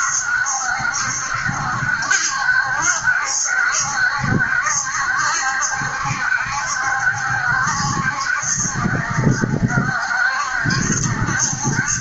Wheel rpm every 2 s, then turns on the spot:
70, 70, 70, 70, 70, 70.
none